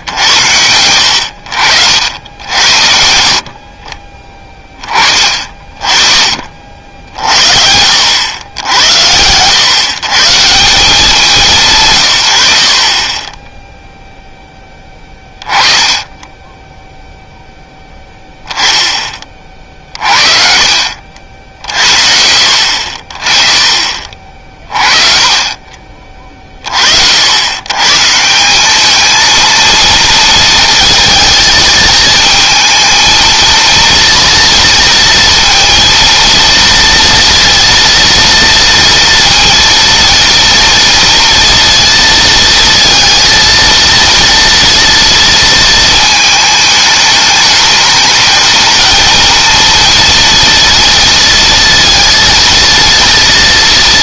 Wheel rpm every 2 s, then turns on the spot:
90, 70, 20, 60, 80, 170, 50, 20, 10, 10, 50, 60, 40, 50, 200, 230, 230, 230, 230, 230, 230, 230, 230, 220, 220, 230, 230.
20-22